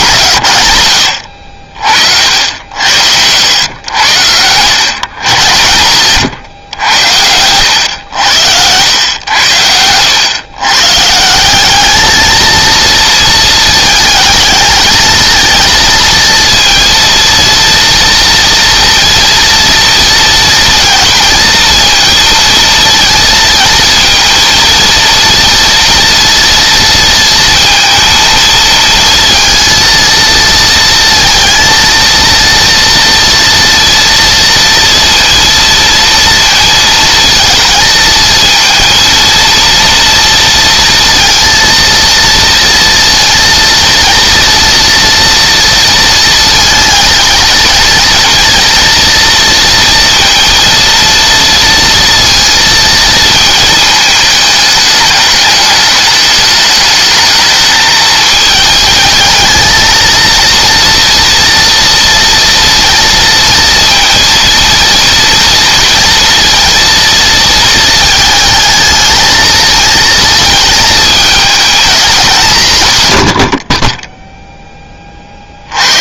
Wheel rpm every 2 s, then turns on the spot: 90, 80, 130, 100, 90, 150, 230, 220, 230, 230, 240, 230, 230, 230, 230, 230, 230, 230, 220, 230, 230, 230, 230, 230, 230, 230, 230, 210, 220, 220, 230, 230, 230, 230, 220, 220, 140, 30.
8-10